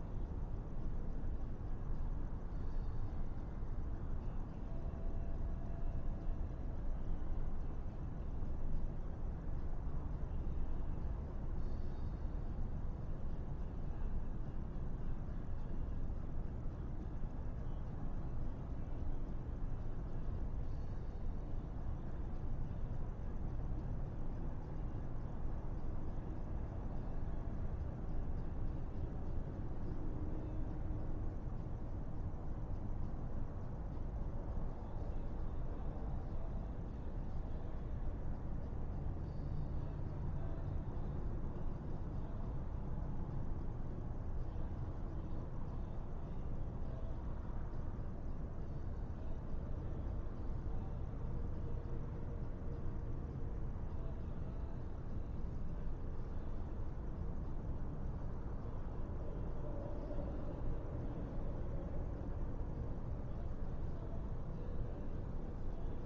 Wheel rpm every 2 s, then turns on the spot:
0, 0, 0, 0, 0, 0, 0, 0, 0, 0, 0, 0, 0, 0, 0, 0, 0, 0, 0, 0, 0, 0, 0, 0, 0, 0, 0, 0, 0, 0, 0, 0, 0.
none